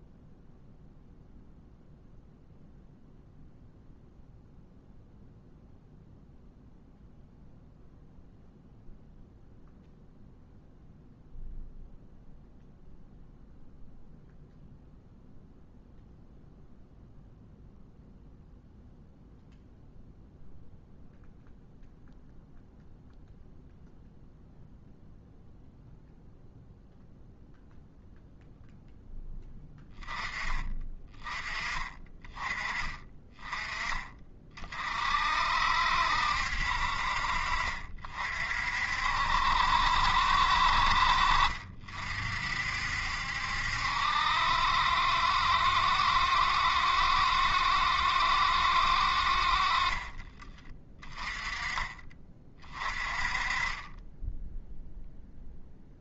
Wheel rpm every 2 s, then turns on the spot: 0, 0, 0, 0, 0, 0, 0, 0, 0, 0, 0, 0, 0, 0, 0, 20, 20, 40, 60, 50, 60, 60, 60, 60, 60, 20, 30, 0.
none